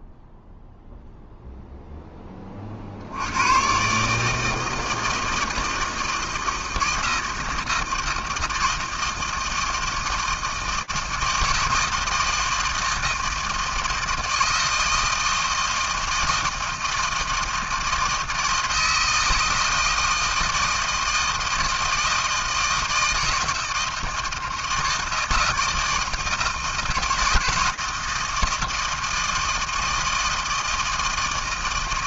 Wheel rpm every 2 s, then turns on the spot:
0, 20, 160, 160, 160, 160, 160, 160, 160, 160, 160, 160, 160, 160, 160, 160.
none